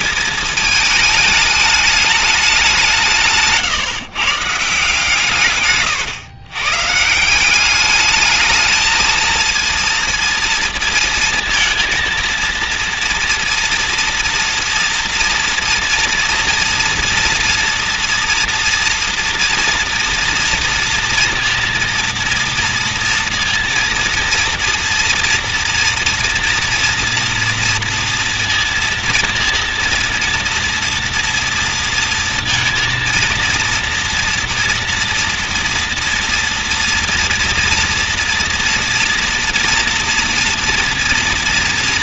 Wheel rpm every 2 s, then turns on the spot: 220, 200, 150, 120, 220, 230, 230, 230, 230, 230, 230, 230, 230, 230, 230, 230, 230, 230, 230, 230, 230.
none